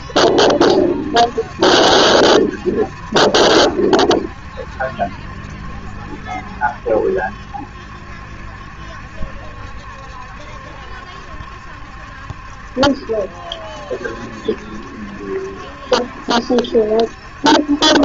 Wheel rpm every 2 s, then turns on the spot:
70, 70, 70, 70, 70, 70, 70, 70, 70.
none